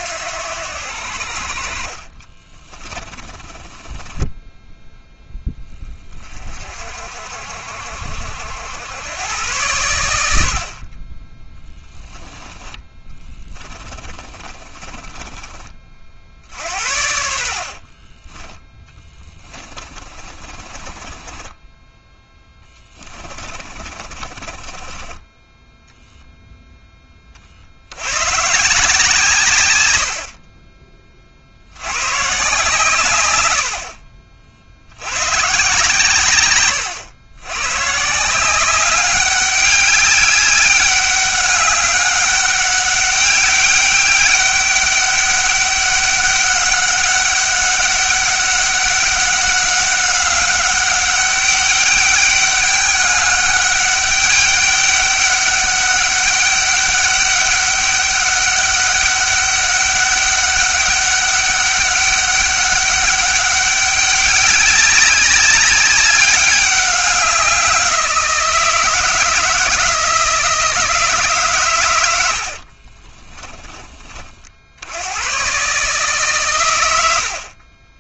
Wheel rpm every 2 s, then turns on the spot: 80, 30, 10, 50, 100, 40, 20, 30, 70, 10, 30, 20, 20, 10, 150, 30, 130, 80, 110, 200, 200, 200, 200, 200, 200, 200, 210, 200, 200, 200, 200, 200, 200, 200, 170, 160, 50, 80, 100.
2-4 12-26 72-74